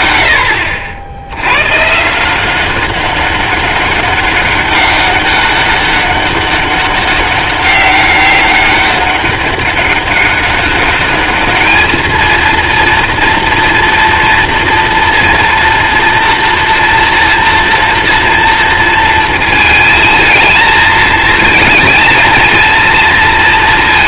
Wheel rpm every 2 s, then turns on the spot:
70, 190, 200, 200, 200, 200, 230, 230, 240, 230, 220, 230.
none